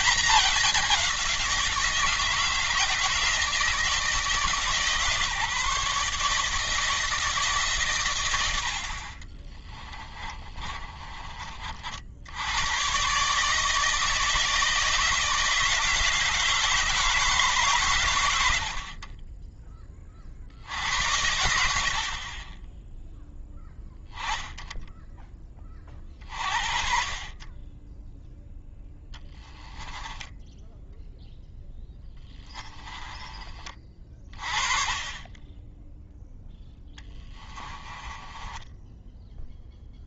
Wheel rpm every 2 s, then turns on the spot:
200, 160, 150, 160, 70, 30, 110, 160, 160, 60, 70, 20, 10, 50, 10, 10, 20, 20, 10, 10.
10-12 28-34 36-40